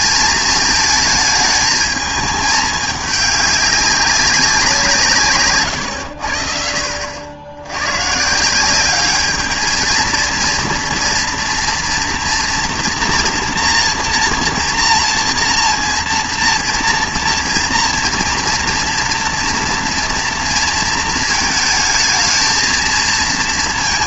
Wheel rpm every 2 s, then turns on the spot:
220, 210, 180, 60, 180, 240, 230, 230, 230, 230, 230, 220.
none